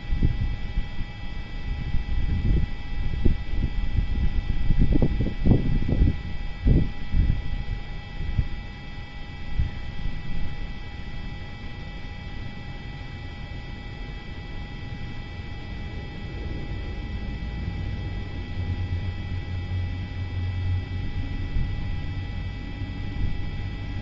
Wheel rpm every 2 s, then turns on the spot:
0, 0, 0, 0, 0, 0, 0, 0, 0, 0, 0, 0.
none